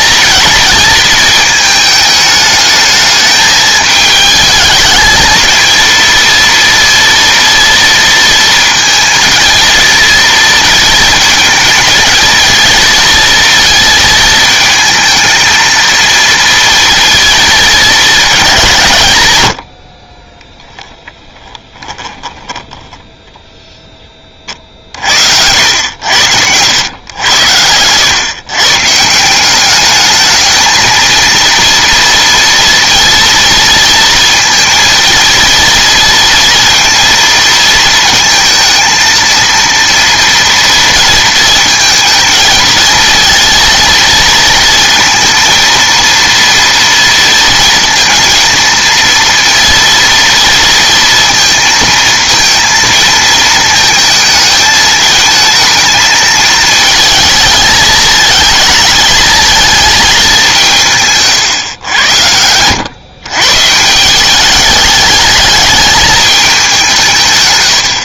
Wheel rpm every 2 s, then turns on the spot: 230, 210, 220, 230, 230, 230, 230, 220, 230, 170, 10, 10, 40, 100, 140, 220, 230, 230, 230, 230, 230, 230, 230, 230, 230, 230, 230, 220, 220, 220, 170, 100, 210, 200.
20-24